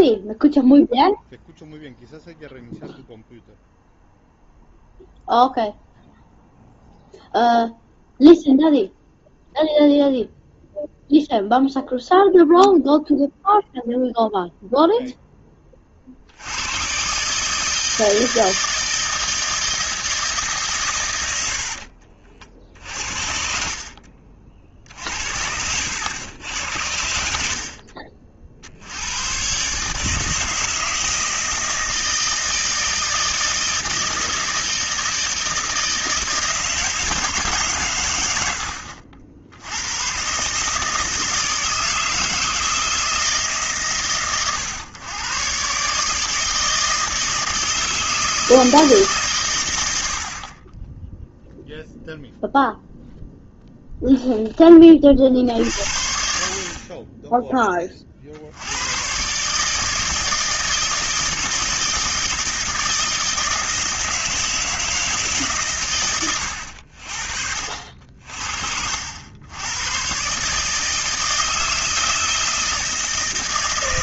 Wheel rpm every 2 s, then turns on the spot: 0, 0, 0, 0, 0, 0, 0, 0, 100, 160, 140, 60, 60, 90, 80, 160, 160, 160, 160, 80, 150, 160, 120, 160, 160, 30, 0, 10, 50, 90, 160, 160, 160, 80, 60, 150, 160.
none